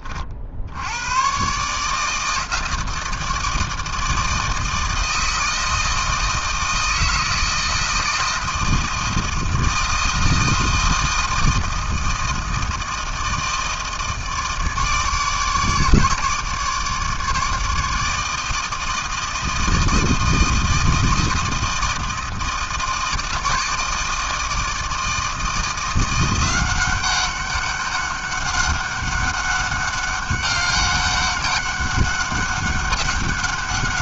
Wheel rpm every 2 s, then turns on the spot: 40, 150, 160, 160, 160, 160, 160, 160, 150, 160, 160, 160, 160, 170, 200, 200, 200.
none